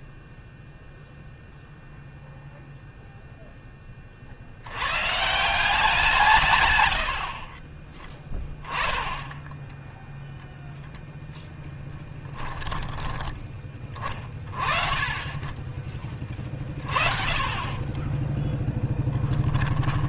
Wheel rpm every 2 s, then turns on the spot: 0, 0, 110, 110, 10, 0, 20, 20, 40, 10.
16-20